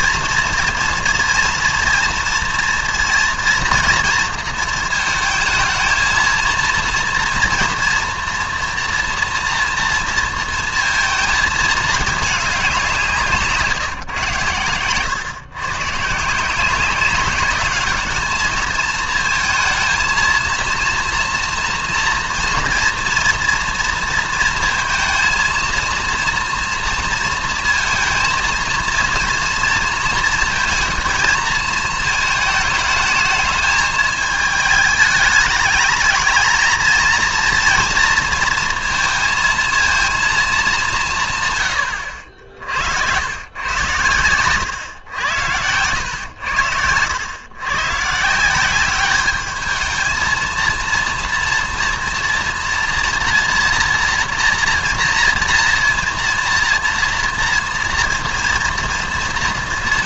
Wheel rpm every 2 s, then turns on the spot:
240, 230, 220, 230, 230, 230, 190, 110, 180, 220, 230, 230, 230, 230, 230, 230, 220, 210, 220, 230, 200, 70, 110, 100, 180, 230, 230, 230, 230, 230.
none